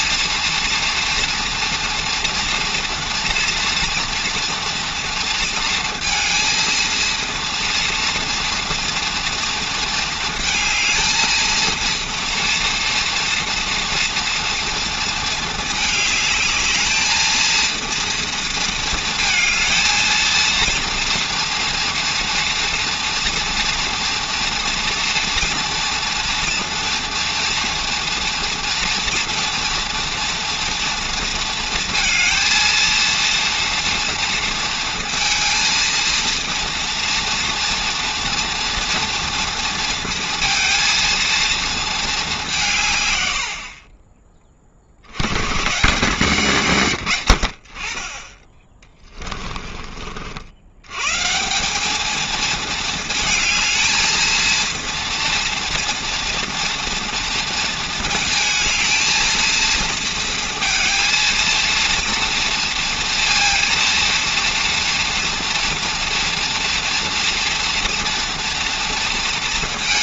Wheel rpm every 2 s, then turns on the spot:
230, 230, 230, 230, 230, 220, 230, 230, 220, 230, 230, 230, 230, 240, 230, 230, 230, 230, 230, 240, 230, 160, 50, 140, 20, 100, 220, 230, 230, 220, 230, 230, 230, 240, 230.
48-50